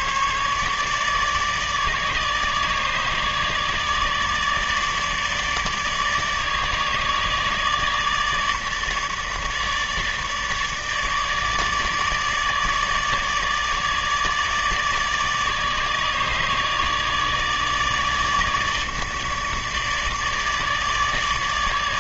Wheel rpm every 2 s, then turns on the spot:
150, 150, 150, 150, 150, 150, 150, 150, 150, 150, 150.
none